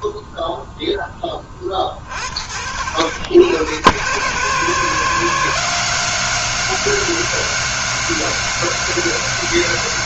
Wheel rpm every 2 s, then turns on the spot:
10, 100, 180, 180, 170.
none